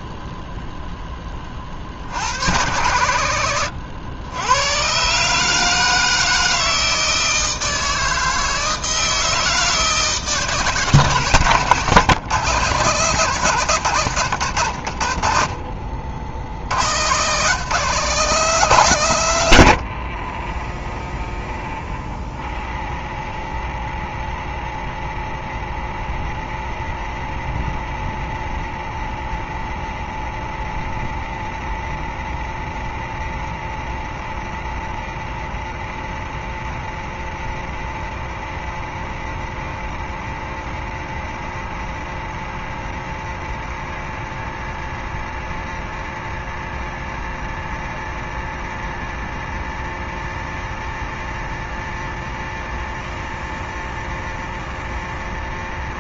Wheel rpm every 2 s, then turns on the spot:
0, 90, 100, 160, 160, 160, 150, 90, 100, 180, 0, 0, 0, 0, 0, 0, 0, 0, 0, 0, 0, 0, 0, 0, 0, 0, 0, 0.
16-18